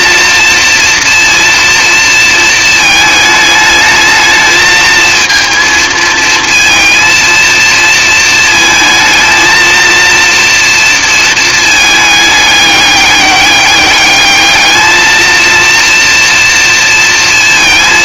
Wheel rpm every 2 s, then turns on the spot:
230, 220, 220, 230, 220, 230, 210, 210, 230.
none